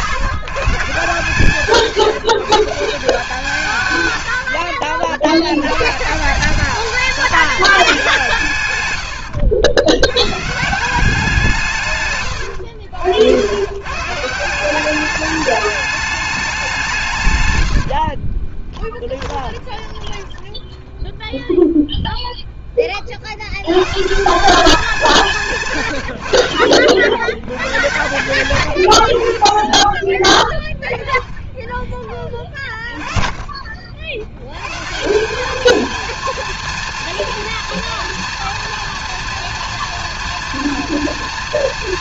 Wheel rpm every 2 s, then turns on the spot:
130, 160, 80, 190, 150, 150, 110, 170, 200, 20, 10, 10, 190, 70, 100, 10, 30, 110, 230, 230, 230.
12-14 18-22